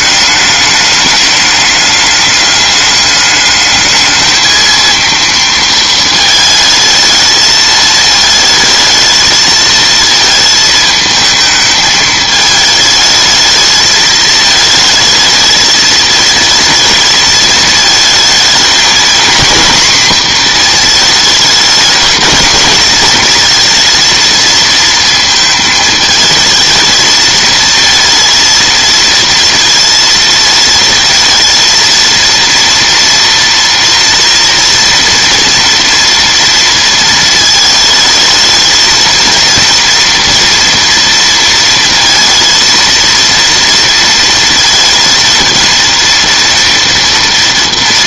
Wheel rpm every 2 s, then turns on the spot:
210, 210, 230, 220, 220, 220, 220, 220, 220, 220, 230, 220, 230, 220, 230, 220, 230, 230, 230, 220, 230, 230, 230, 230.
none